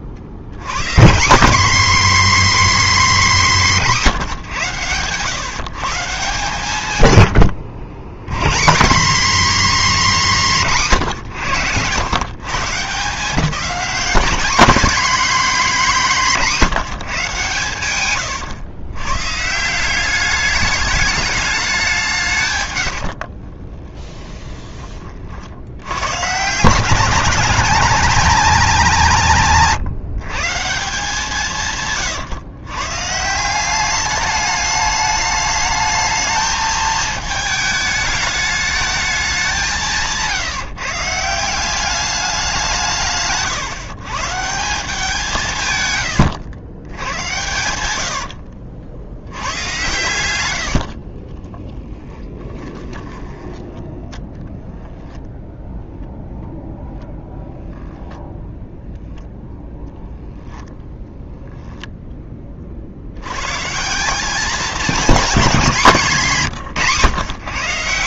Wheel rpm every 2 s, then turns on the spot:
120, 280, 140, 140, 180, 190, 160, 220, 180, 120, 210, 120, 20, 160, 210, 160, 120, 210, 220, 220, 150, 190, 160, 100, 70, 80, 20, 0, 0, 0, 0, 40, 220, 140.
22-24 50-54